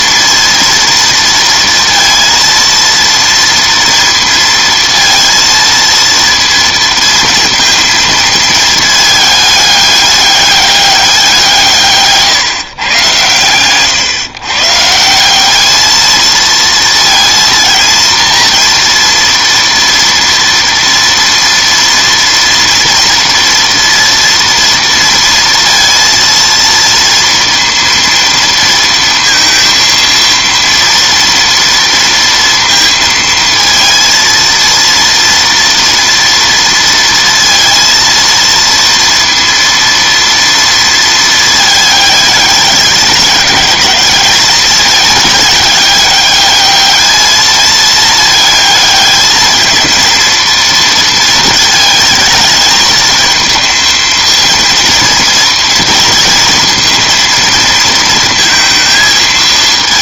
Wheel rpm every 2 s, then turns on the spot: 230, 230, 230, 230, 220, 200, 130, 140, 230, 230, 230, 230, 230, 230, 230, 230, 230, 230, 230, 230, 230, 210, 210, 210, 220, 230, 220, 230, 230, 230.
none